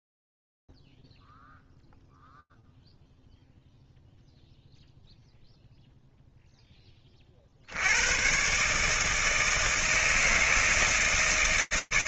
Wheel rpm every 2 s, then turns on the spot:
0, 0, 0, 0, 100, 160.
none